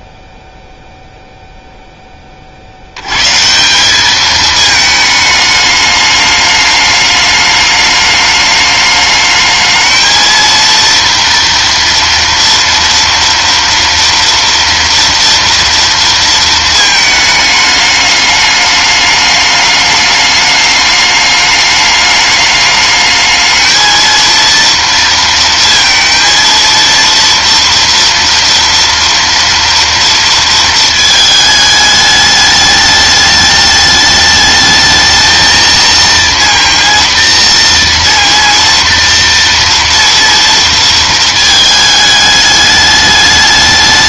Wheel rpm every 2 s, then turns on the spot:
0, 50, 220, 210, 210, 230, 230, 230, 230, 210, 210, 210, 230, 230, 230, 230, 210, 220, 230, 230, 230, 210.
none